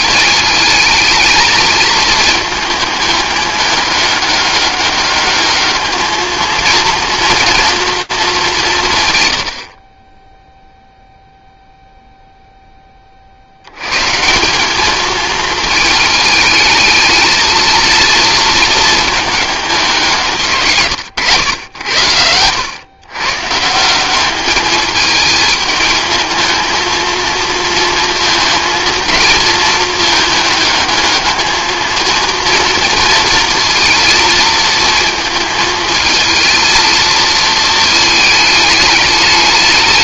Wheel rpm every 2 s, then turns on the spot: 220, 220, 200, 230, 160, 0, 10, 210, 220, 230, 140, 110, 210, 230, 230, 210, 230, 230, 220, 210.
none